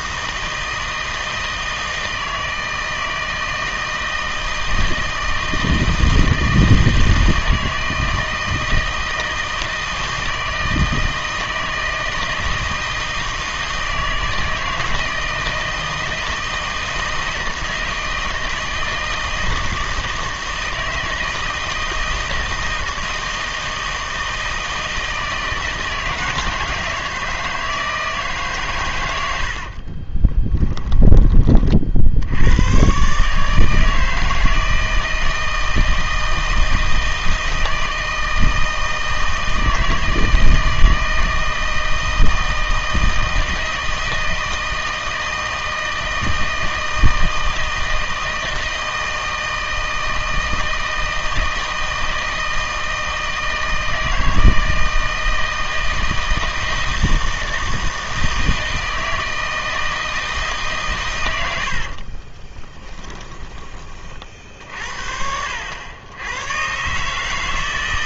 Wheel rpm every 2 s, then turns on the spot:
160, 160, 160, 160, 160, 160, 160, 160, 160, 160, 160, 160, 160, 160, 120, 10, 110, 160, 160, 160, 160, 160, 160, 160, 160, 160, 160, 160, 160, 160, 150, 20, 60, 120.
30-32 62-64